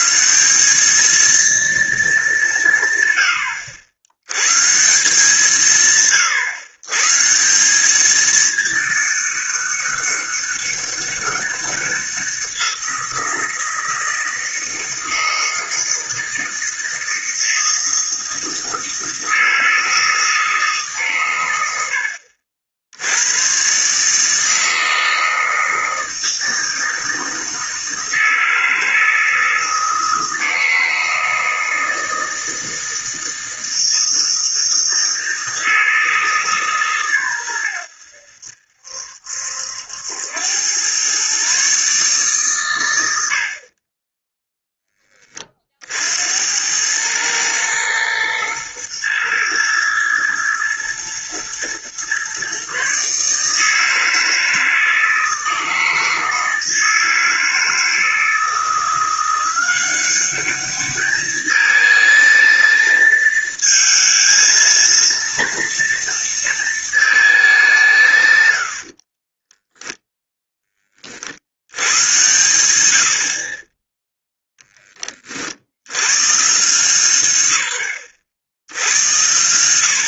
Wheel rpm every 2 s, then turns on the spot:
210, 130, 160, 140, 210, 200, 180, 160, 160, 160, 150, 80, 160, 160, 160, 160, 160, 160, 140, 70, 110, 110, 10, 100, 120, 110, 140, 160, 160, 170, 200, 230, 230, 220, 60, 30, 80, 20, 150, 90.
68-70